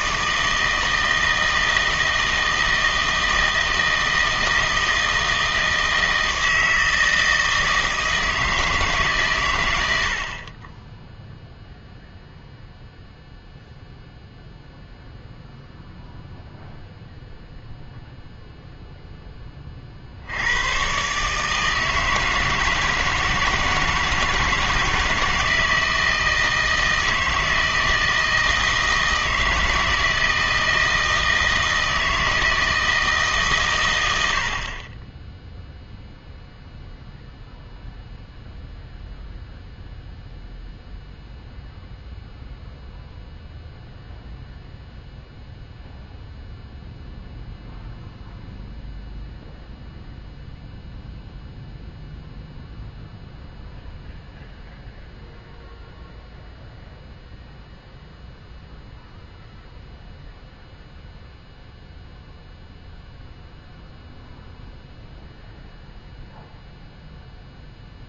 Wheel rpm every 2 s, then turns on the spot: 160, 160, 160, 160, 160, 20, 0, 0, 0, 0, 110, 160, 160, 160, 160, 160, 160, 30, 0, 0, 0, 0, 0, 0, 0, 0, 0, 0, 0, 0, 0, 0, 0, 0.
none